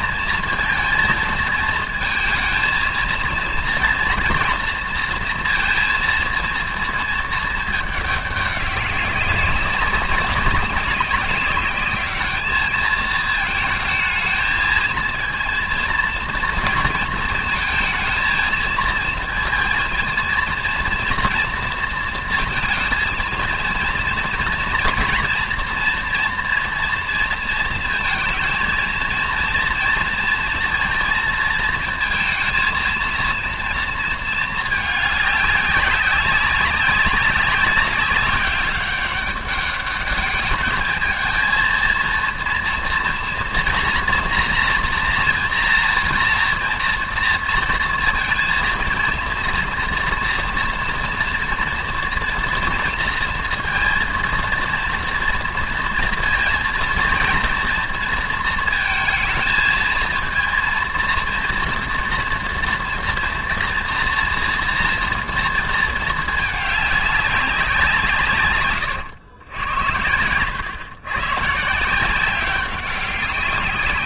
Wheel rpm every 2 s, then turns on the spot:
220, 230, 230, 230, 200, 190, 210, 220, 230, 230, 230, 230, 230, 230, 230, 230, 220, 220, 190, 200, 210, 230, 230, 230, 230, 230, 230, 230, 230, 230, 230, 240, 230, 210, 130, 110, 190.
none